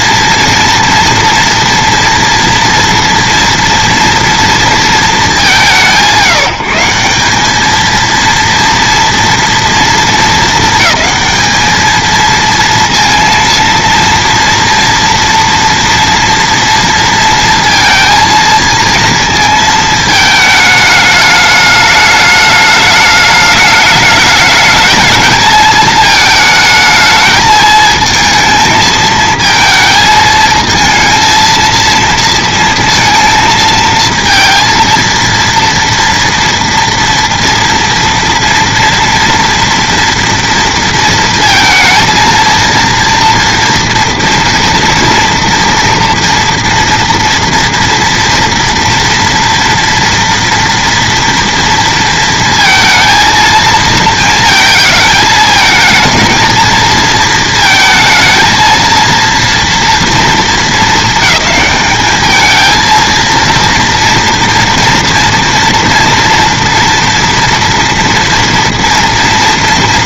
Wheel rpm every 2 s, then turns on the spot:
230, 230, 230, 170, 230, 220, 230, 230, 230, 230, 210, 210, 210, 220, 220, 220, 230, 230, 230, 230, 230, 230, 240, 230, 230, 230, 230, 220, 230, 230, 220, 220, 230, 230, 230.
none